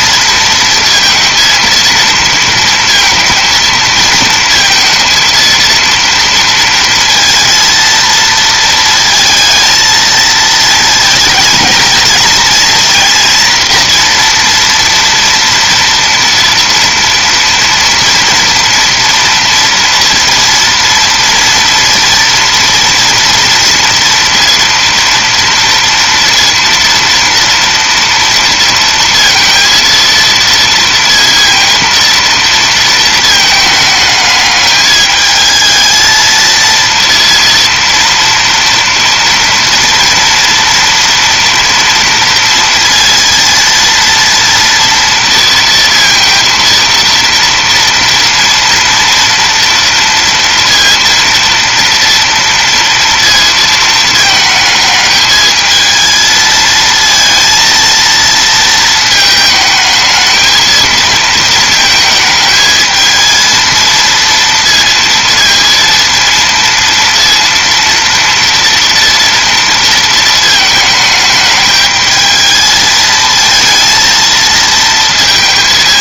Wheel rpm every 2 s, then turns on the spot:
230, 230, 230, 230, 230, 220, 230, 240, 240, 230, 230, 230, 230, 230, 230, 230, 230, 210, 230, 230, 230, 230, 230, 230, 230, 230, 230, 220, 230, 220, 220, 220, 230, 230, 230, 220, 220, 230.
none